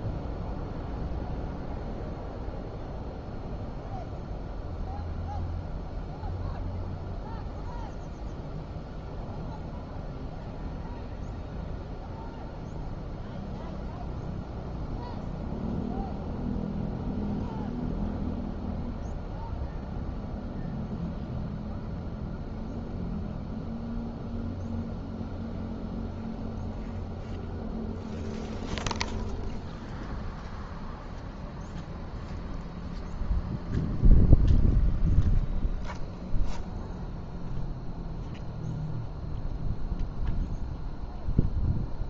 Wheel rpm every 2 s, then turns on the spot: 0, 0, 0, 0, 0, 0, 0, 0, 0, 0, 0, 0, 0, 0, 0, 0, 0, 0, 0, 0, 0.
none